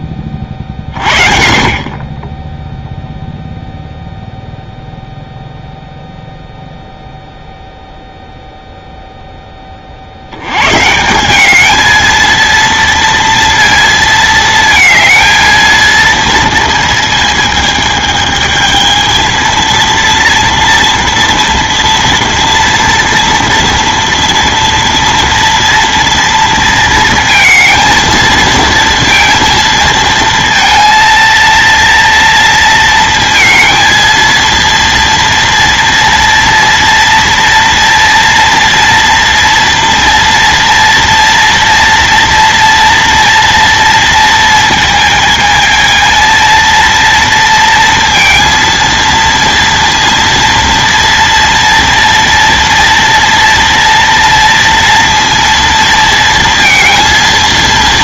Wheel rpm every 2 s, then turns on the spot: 40, 10, 0, 0, 0, 120, 230, 220, 230, 220, 230, 230, 230, 230, 230, 230, 230, 230, 230, 230, 230, 230, 220, 230, 230, 230, 230, 230, 230.
none